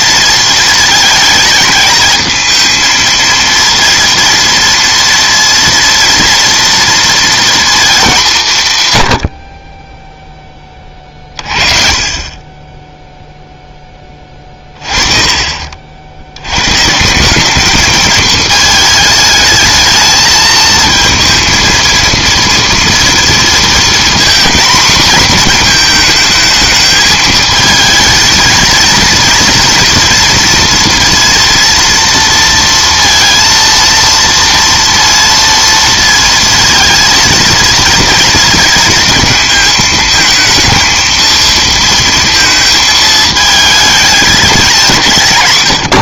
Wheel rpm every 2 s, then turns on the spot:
230, 220, 230, 230, 140, 20, 10, 30, 120, 220, 230, 230, 240, 220, 230, 230, 230, 230, 230, 240, 230, 220, 190.
none